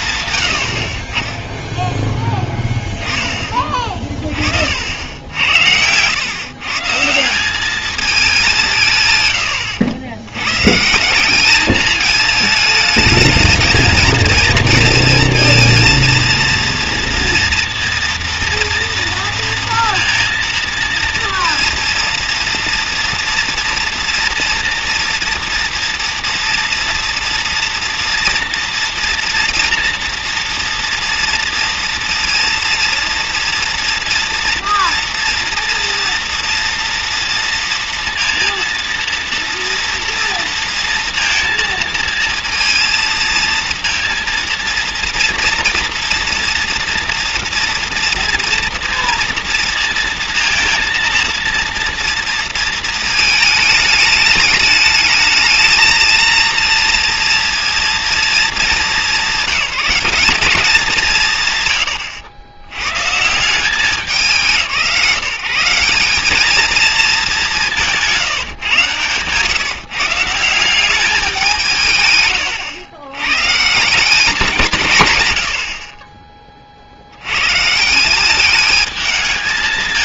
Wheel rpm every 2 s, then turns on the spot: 50, 10, 60, 140, 160, 140, 220, 230, 230, 230, 230, 230, 230, 230, 240, 230, 230, 230, 230, 230, 230, 230, 230, 230, 230, 230, 230, 210, 230, 210, 200, 100, 150, 210, 150, 180, 130, 190, 30, 210.
none